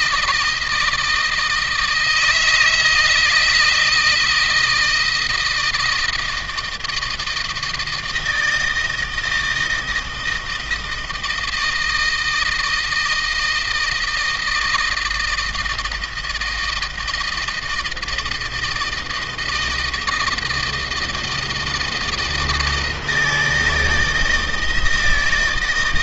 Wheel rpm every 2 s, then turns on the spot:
170, 160, 160, 160, 160, 160, 160, 160, 160, 160, 160, 160, 160.
none